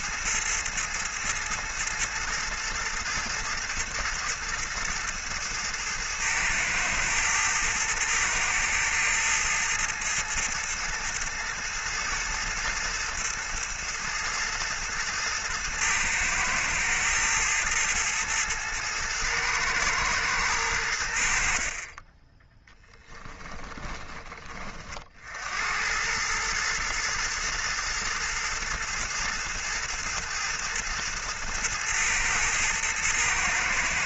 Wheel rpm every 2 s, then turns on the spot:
110, 110, 110, 110, 110, 110, 110, 110, 110, 110, 100, 10, 40, 110, 110, 110, 110.
none